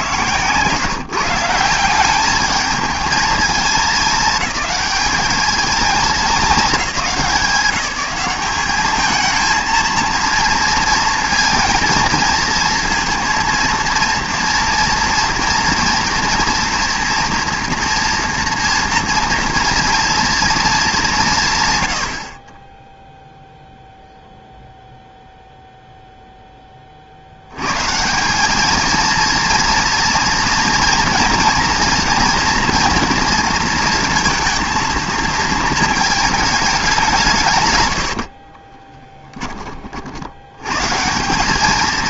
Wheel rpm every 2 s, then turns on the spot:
140, 210, 220, 200, 200, 230, 230, 230, 230, 230, 220, 20, 0, 30, 220, 230, 230, 230, 200, 20, 110.
38-40